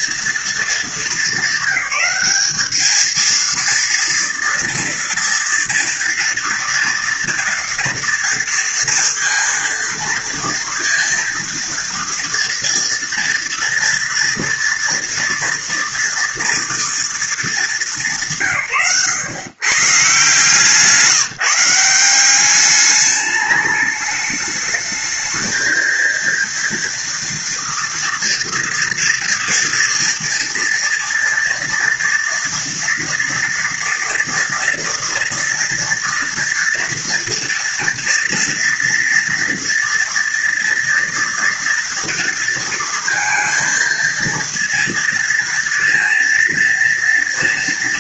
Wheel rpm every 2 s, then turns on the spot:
220, 200, 230, 230, 230, 230, 230, 230, 240, 160, 150, 190, 210, 230, 230, 230, 230, 230, 230, 230, 230, 230, 230, 230.
none